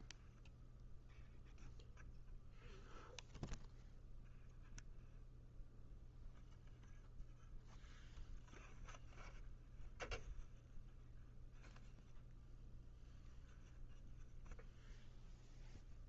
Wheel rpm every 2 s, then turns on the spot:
0, 0, 0, 0, 0, 0, 0, 0.
none